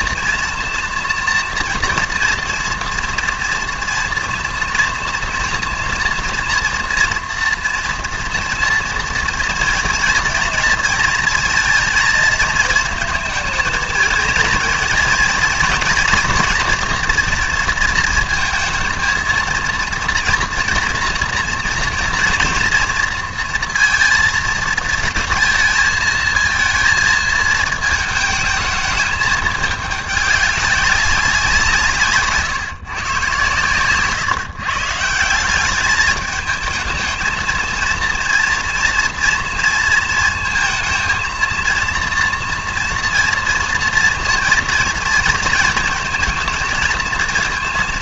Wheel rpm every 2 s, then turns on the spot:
240, 230, 240, 240, 230, 230, 220, 230, 240, 230, 240, 230, 230, 230, 220, 200, 140, 150, 220, 230, 220, 240, 230, 220.
none